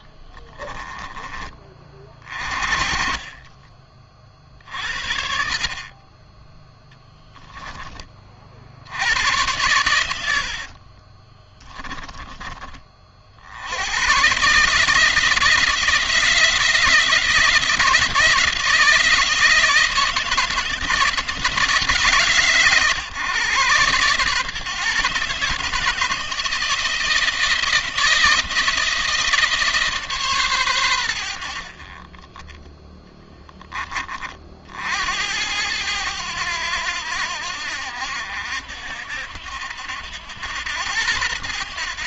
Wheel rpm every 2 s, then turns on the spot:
20, 40, 60, 10, 80, 40, 40, 150, 160, 160, 160, 140, 140, 160, 160, 110, 10, 70, 90, 70, 90.
0-4 10-12